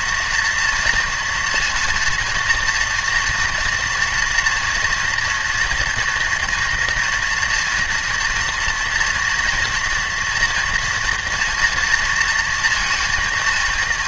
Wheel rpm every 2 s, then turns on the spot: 230, 230, 230, 230, 240, 240, 230.
none